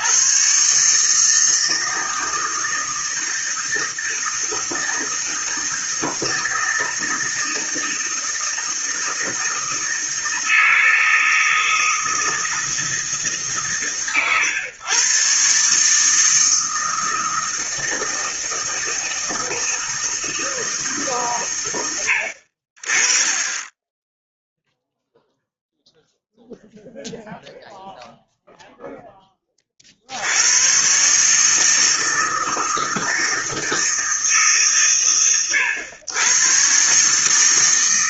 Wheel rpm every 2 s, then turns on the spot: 140, 160, 160, 160, 160, 160, 160, 120, 160, 160, 160, 50, 0, 0, 0, 110, 160, 140, 130.
none